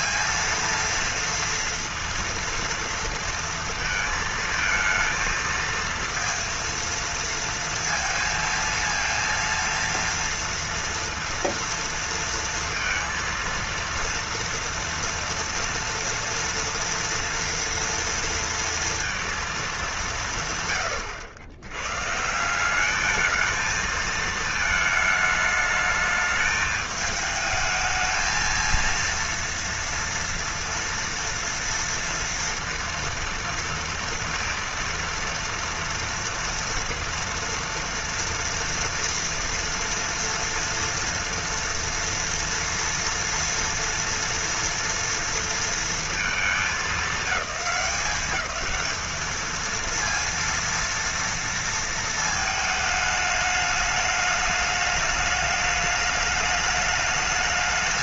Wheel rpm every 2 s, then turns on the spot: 230, 230, 220, 230, 230, 230, 230, 230, 230, 230, 120, 190, 220, 220, 230, 230, 230, 230, 240, 230, 230, 230, 230, 210, 210, 230, 220, 210, 210.
none